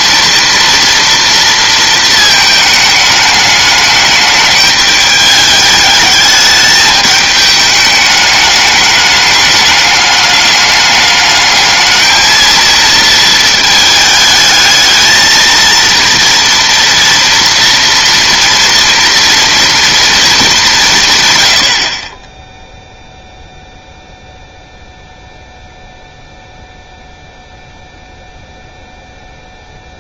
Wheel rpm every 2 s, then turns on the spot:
240, 220, 210, 210, 210, 210, 220, 220, 230, 230, 190, 0, 0, 0, 0.
none